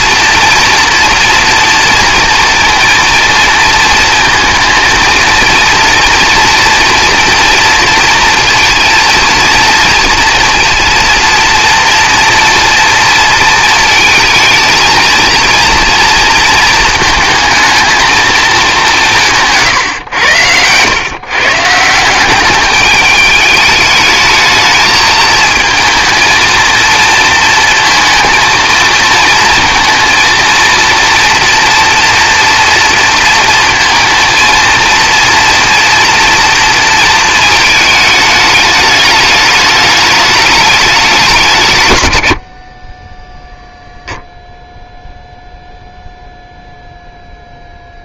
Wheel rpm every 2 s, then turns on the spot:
230, 230, 230, 230, 230, 230, 230, 230, 230, 210, 110, 200, 220, 230, 230, 230, 230, 230, 230, 210, 210, 40, 0, 0.
none